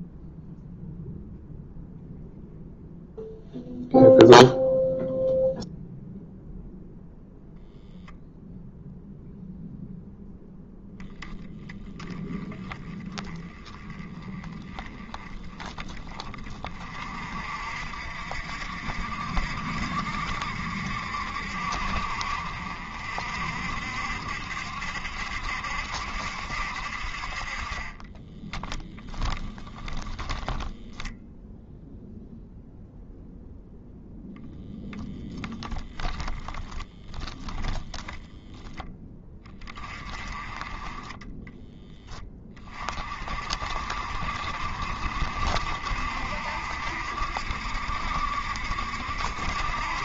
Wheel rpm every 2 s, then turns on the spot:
0, 0, 0, 0, 0, 0, 20, 10, 40, 60, 70, 60, 70, 60, 10, 0, 0, 10, 10, 20, 20, 30, 50, 60, 70.
28-30 36-38